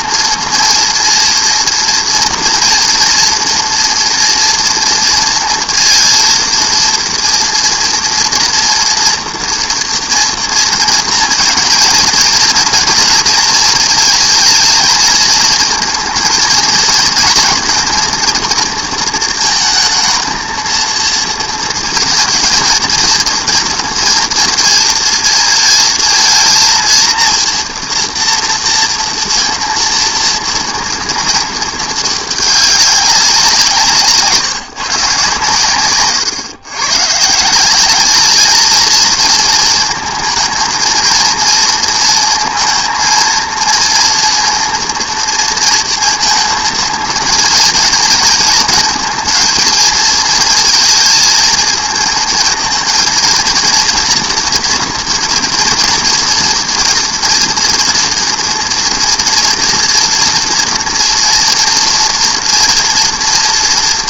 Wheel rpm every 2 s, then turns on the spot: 230, 230, 230, 230, 230, 230, 230, 220, 230, 230, 220, 230, 230, 230, 230, 230, 200, 150, 120, 220, 220, 230, 230, 230, 230, 230, 230, 240, 230, 230, 240, 240.
none